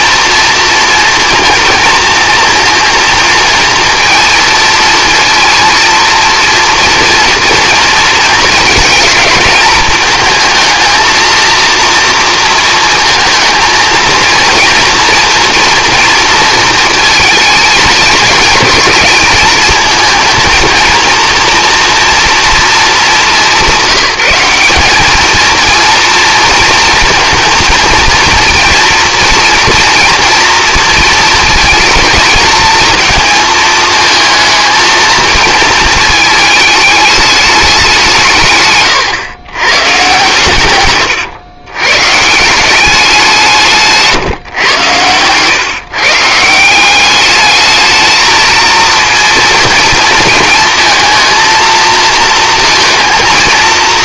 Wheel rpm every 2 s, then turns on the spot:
230, 230, 230, 230, 230, 220, 230, 230, 230, 220, 230, 220, 200, 230, 230, 240, 230, 220, 220, 130, 120, 180, 110, 180, 230, 220, 230.
none